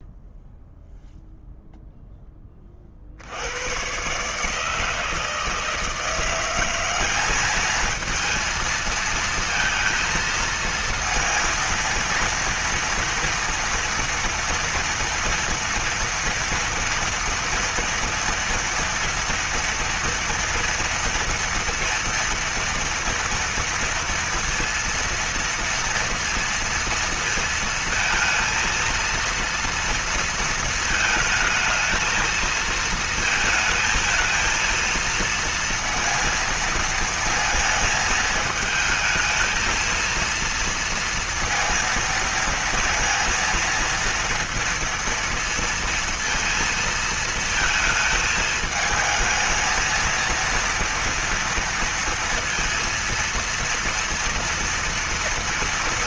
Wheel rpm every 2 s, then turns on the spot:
0, 30, 150, 180, 230, 230, 230, 230, 230, 230, 230, 230, 230, 230, 230, 230, 220, 230, 230, 220, 230, 230, 230, 230, 220, 230, 230, 230.
none